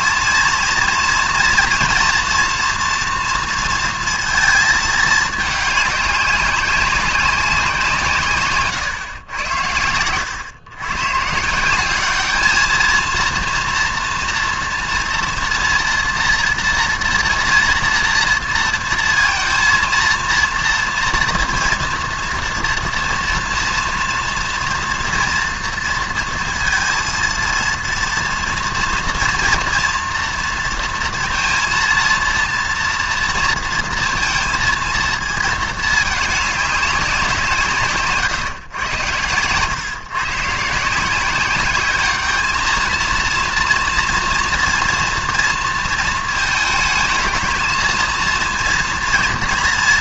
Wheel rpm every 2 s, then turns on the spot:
230, 230, 220, 200, 130, 110, 220, 230, 230, 230, 230, 230, 230, 230, 230, 230, 230, 230, 190, 110, 150, 220, 230, 220, 230.
none